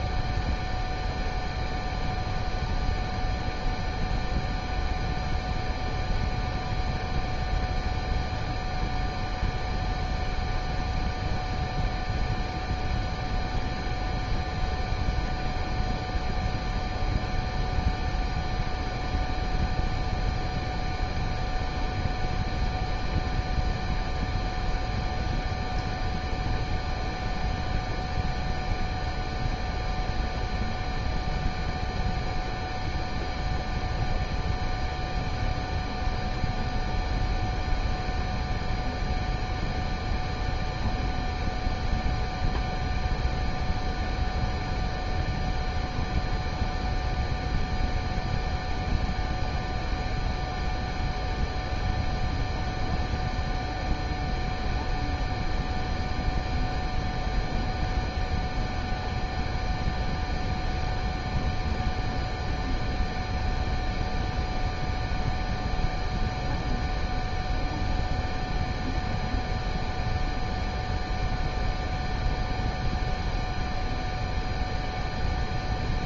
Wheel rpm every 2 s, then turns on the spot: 0, 0, 0, 0, 0, 0, 0, 0, 0, 0, 0, 0, 0, 0, 0, 0, 0, 0, 0, 0, 0, 0, 0, 0, 0, 0, 0, 0, 0, 0, 0, 0, 0, 0, 0, 0, 0, 0.
none